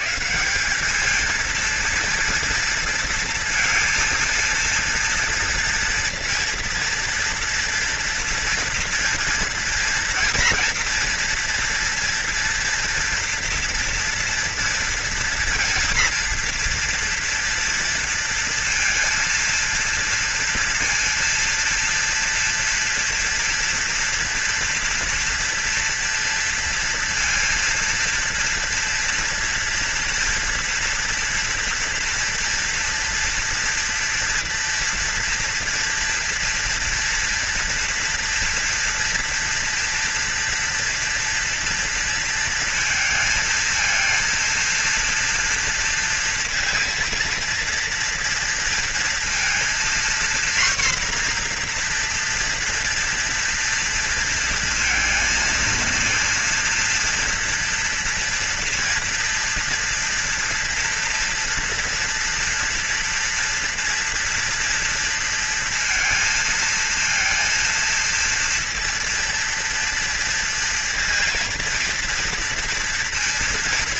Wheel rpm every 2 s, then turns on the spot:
120, 230, 230, 230, 230, 230, 230, 230, 230, 230, 230, 230, 230, 240, 230, 230, 240, 230, 230, 240, 230, 230, 230, 230, 230, 240, 240, 230, 230, 230, 240, 240, 230, 230, 230, 230, 230.
none